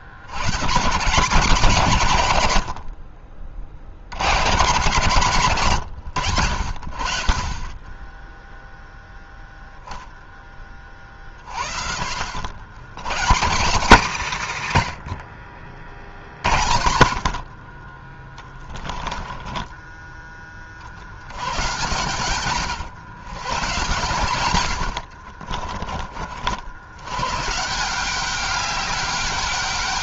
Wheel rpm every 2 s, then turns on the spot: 120, 100, 110, 70, 0, 20, 80, 140, 80, 20, 30, 120, 100, 80, 200.
18-20